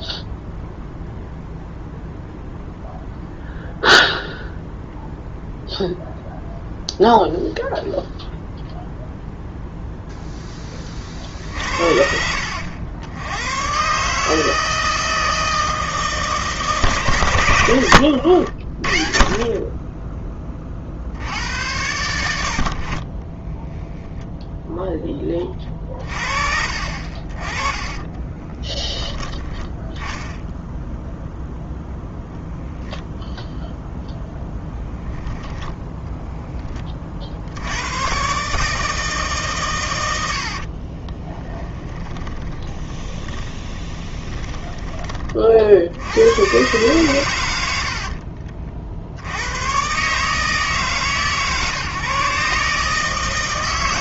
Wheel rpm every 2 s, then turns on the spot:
0, 0, 0, 0, 0, 30, 80, 160, 140, 50, 50, 70, 0, 50, 20, 0, 0, 0, 20, 150, 30, 20, 20, 120, 50, 140, 140.
40-46